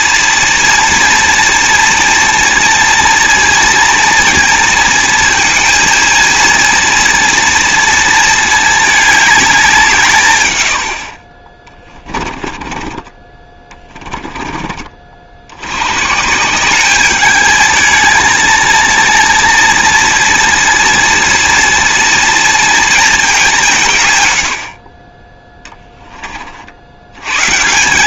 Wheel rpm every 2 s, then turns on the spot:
230, 230, 230, 230, 220, 100, 30, 20, 180, 220, 230, 230, 80, 60.
12-14